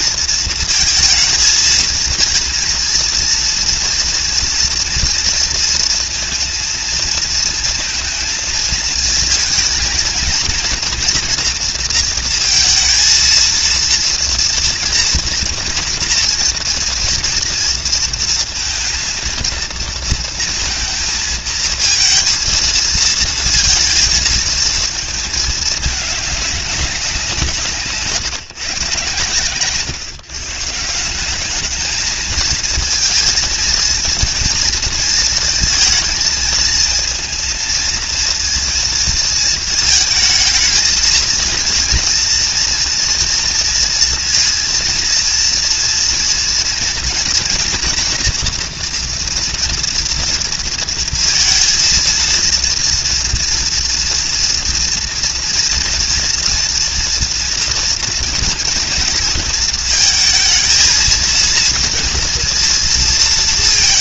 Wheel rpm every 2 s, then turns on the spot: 220, 230, 230, 230, 220, 230, 230, 230, 240, 230, 230, 230, 220, 180, 130, 170, 230, 230, 220, 230, 220, 230, 230, 240, 230, 230, 230, 230, 240, 230, 230, 220.
none